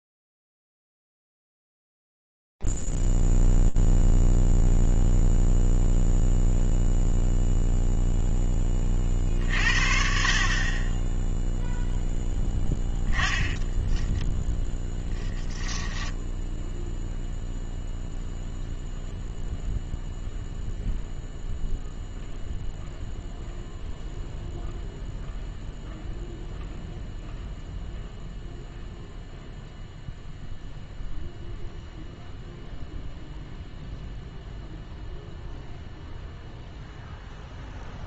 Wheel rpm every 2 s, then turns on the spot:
0, 0, 0, 0, 0, 50, 0, 10, 10, 0, 0, 0, 0, 0, 0, 0, 0, 0, 0.
none